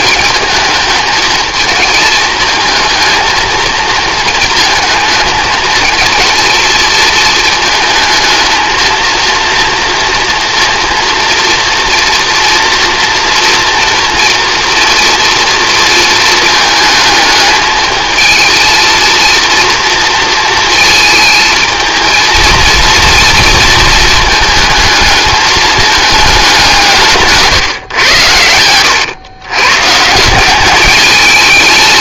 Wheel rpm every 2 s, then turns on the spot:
220, 220, 220, 220, 230, 230, 230, 230, 220, 230, 220, 230, 220, 170, 100, 210.
none